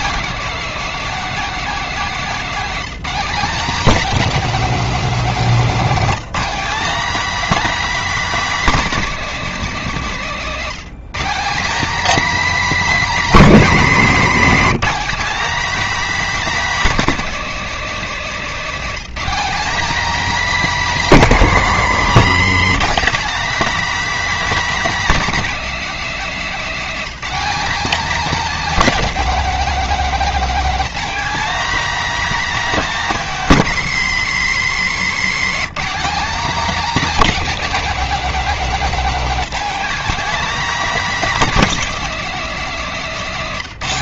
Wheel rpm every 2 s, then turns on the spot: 250, 230, 230, 260, 230, 210, 250, 250, 240, 220, 240, 230, 270, 230, 250, 260, 250, 210, 260, 240, 260, 220.
34-36